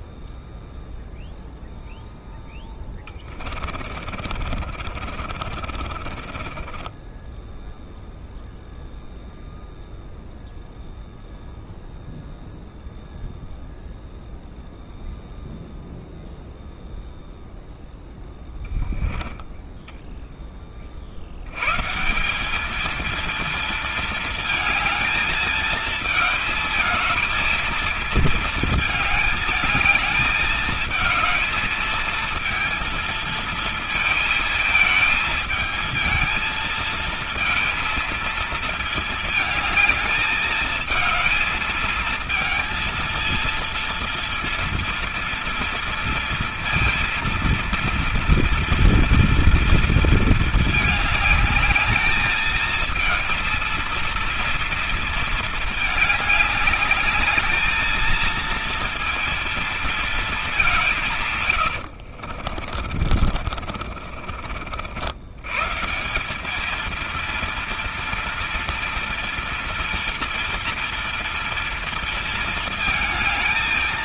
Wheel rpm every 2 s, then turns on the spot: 0, 10, 50, 20, 0, 0, 0, 0, 0, 10, 40, 210, 220, 220, 220, 220, 230, 220, 230, 220, 220, 230, 230, 230, 230, 210, 220, 230, 210, 230, 190, 50, 70, 220, 230, 230, 230.
2-8 18-20 62-64